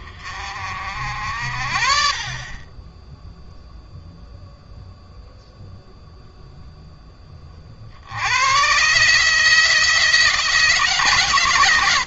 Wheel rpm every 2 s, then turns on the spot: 60, 20, 0, 0, 120, 150.
none